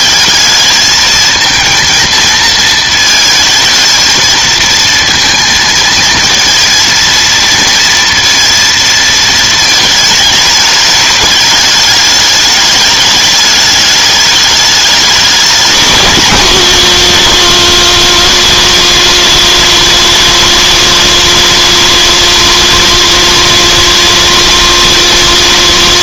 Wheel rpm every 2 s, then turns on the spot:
220, 220, 230, 230, 220, 210, 210, 200, 130, 120, 120, 120, 120.
none